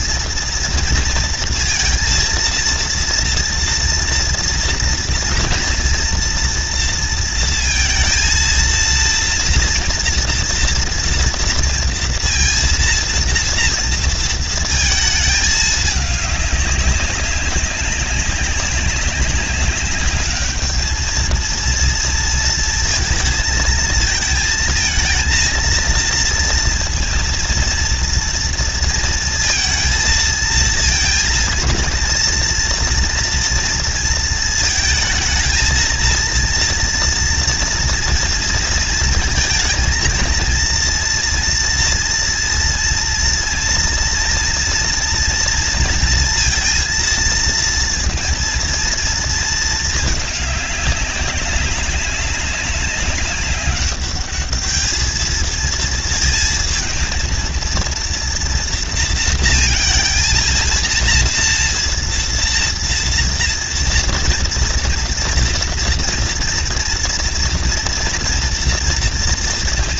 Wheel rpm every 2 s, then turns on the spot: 240, 230, 230, 240, 230, 230, 230, 230, 210, 200, 210, 230, 230, 230, 230, 230, 230, 220, 230, 230, 230, 230, 230, 230, 230, 210, 190, 210, 220, 230, 230, 230, 230, 230, 230.
none